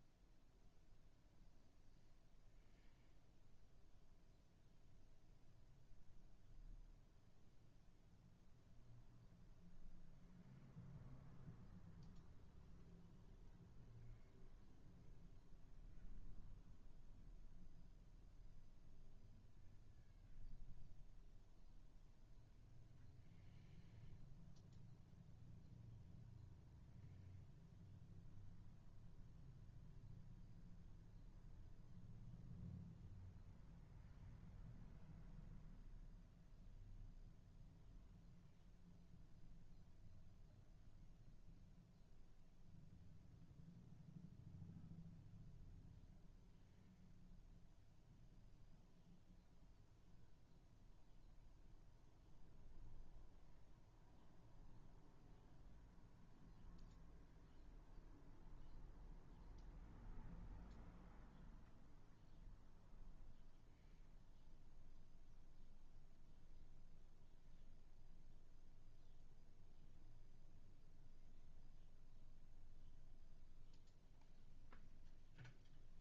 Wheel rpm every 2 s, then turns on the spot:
0, 0, 0, 0, 0, 0, 0, 0, 0, 0, 0, 0, 0, 0, 0, 0, 0, 0, 0, 0, 0, 0, 0, 0, 0, 0, 0, 0, 0, 0, 0, 0, 0, 0, 0, 0, 0, 0.
none